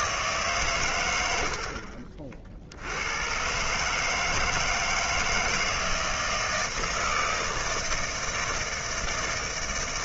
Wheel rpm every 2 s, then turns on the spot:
140, 70, 160, 160, 160.
none